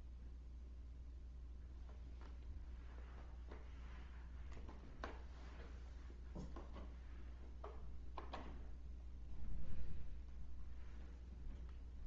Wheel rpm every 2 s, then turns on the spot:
0, 0, 0, 0, 0, 0.
none